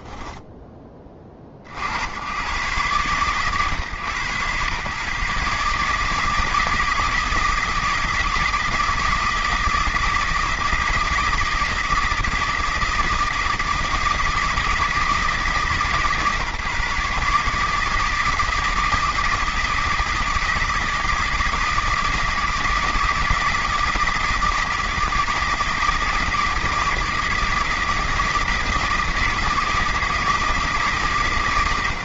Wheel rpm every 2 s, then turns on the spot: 60, 130, 150, 160, 160, 160, 160, 160, 160, 160, 160, 160, 160, 160, 160, 140.
none